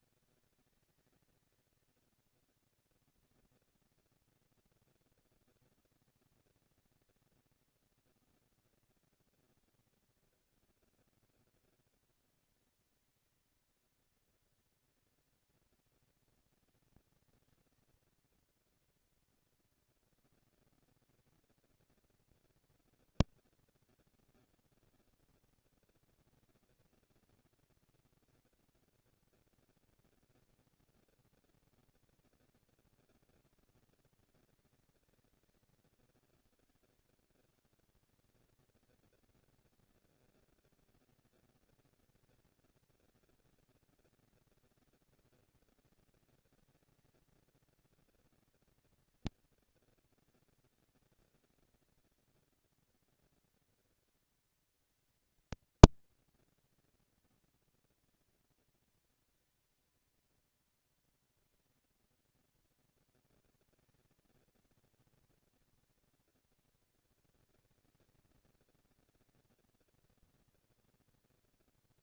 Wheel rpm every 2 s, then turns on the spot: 230, 230, 230, 230, 230, 230, 220, 230, 230, 240, 230, 230, 230, 240, 240, 230, 220, 200, 130, 170, 230, 230, 230, 230, 220, 230, 230, 230, 230, 230, 230, 240, 230, 230, 220, 230.
none